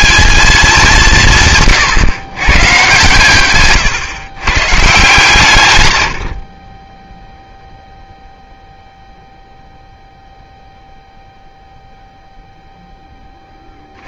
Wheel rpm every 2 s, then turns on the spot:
200, 130, 140, 30, 0, 0, 0.
6-8